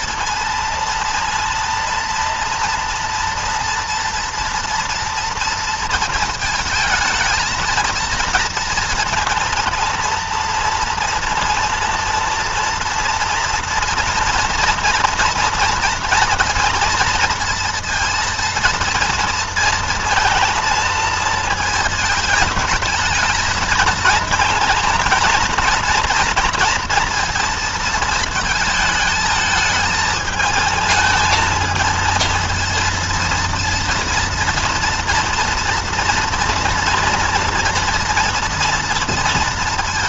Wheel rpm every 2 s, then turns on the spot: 230, 230, 230, 220, 230, 230, 230, 230, 230, 230, 230, 220, 220, 240, 220, 220, 230, 230, 240, 230.
none